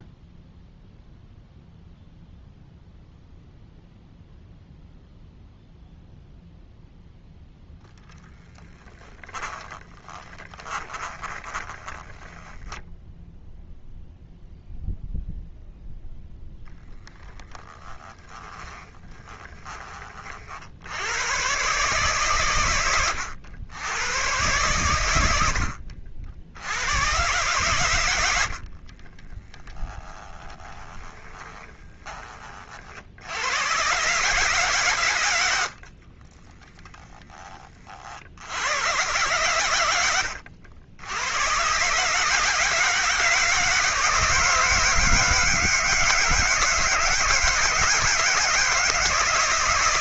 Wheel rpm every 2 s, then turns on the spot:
0, 0, 0, 0, 20, 20, 0, 0, 0, 20, 100, 110, 100, 100, 40, 20, 50, 110, 10, 110, 80, 160, 160, 160, 160.
8-12 18-20 28-32